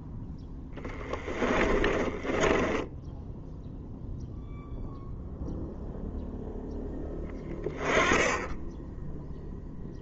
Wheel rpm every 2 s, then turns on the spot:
10, 10, 0, 0, 10.
0-4